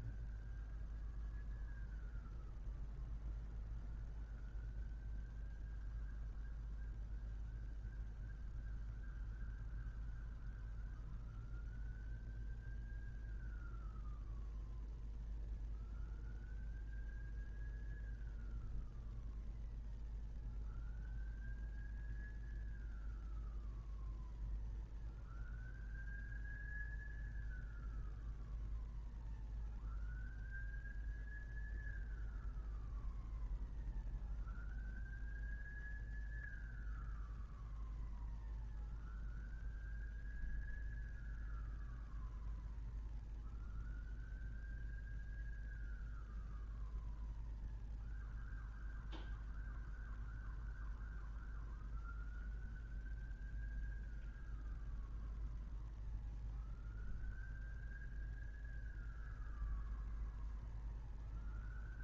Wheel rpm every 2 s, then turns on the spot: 0, 0, 0, 0, 0, 0, 0, 0, 0, 0, 0, 0, 0, 0, 0, 0, 0, 0, 0, 0, 0, 0, 0, 0, 0, 0, 0, 0, 0, 0, 0.
none